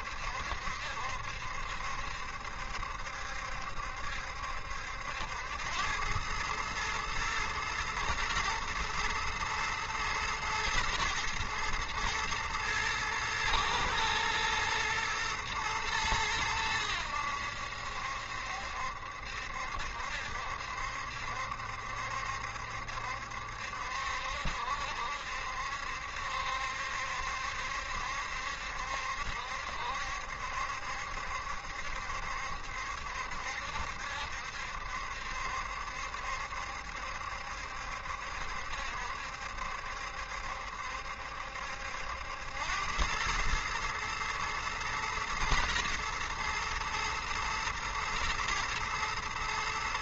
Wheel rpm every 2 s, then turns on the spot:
70, 70, 80, 110, 110, 110, 110, 110, 90, 70, 70, 70, 70, 70, 70, 70, 70, 70, 70, 70, 70, 100, 120, 120, 110.
none